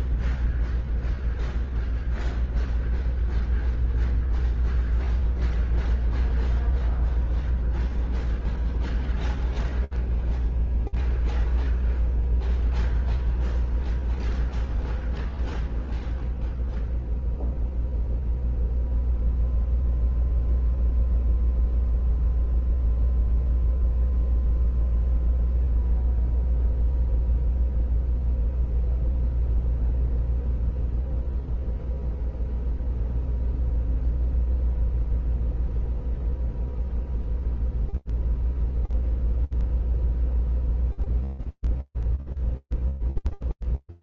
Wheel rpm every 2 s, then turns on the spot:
0, 0, 0, 0, 0, 0, 0, 0, 0, 0, 0, 0, 0, 0, 0, 0, 0, 0, 0, 0, 0, 0.
none